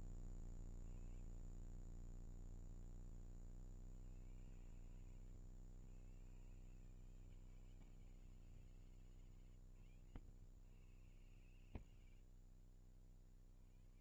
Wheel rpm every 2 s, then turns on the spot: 10, 110, 140, 120, 110, 50, 150.
6-8